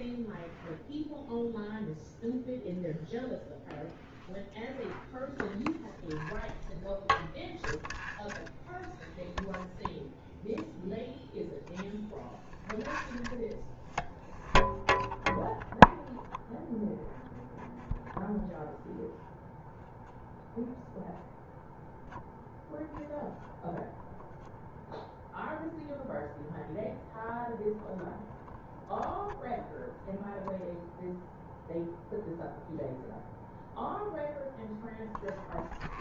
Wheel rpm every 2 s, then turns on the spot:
0, 0, 0, 0, 0, 0, 0, 0, 0, 0, 0, 0, 0, 0, 0, 0, 0, 0.
none